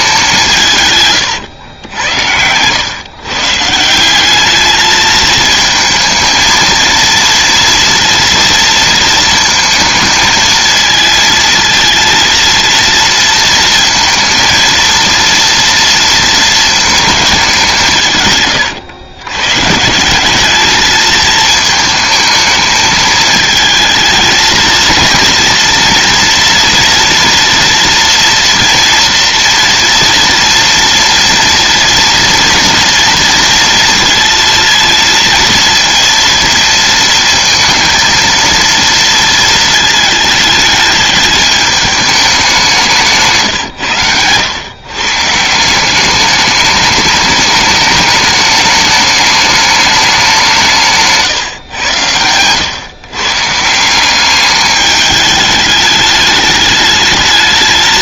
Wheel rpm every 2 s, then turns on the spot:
160, 110, 210, 230, 230, 220, 230, 230, 230, 120, 210, 220, 230, 240, 230, 230, 240, 230, 230, 230, 220, 180, 120, 210, 210, 170, 120, 210, 210.
none